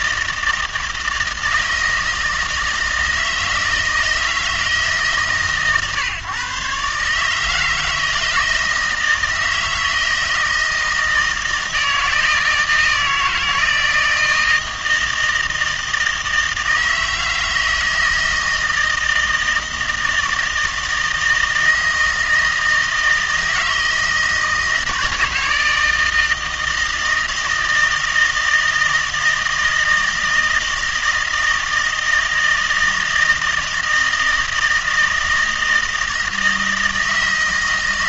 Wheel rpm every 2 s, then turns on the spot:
160, 160, 150, 140, 160, 160, 160, 160, 160, 160, 160, 160, 160, 160, 160, 160, 160, 160, 160.
none